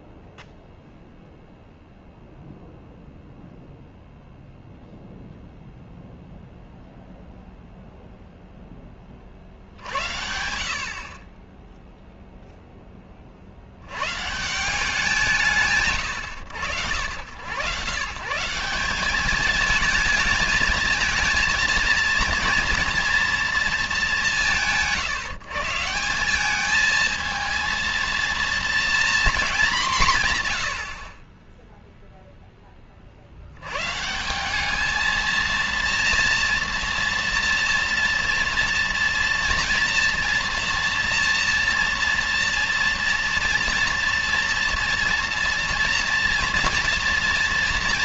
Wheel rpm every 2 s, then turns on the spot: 0, 0, 0, 0, 0, 70, 0, 160, 90, 170, 210, 230, 160, 200, 230, 120, 10, 190, 230, 230, 230, 230, 230, 230.
none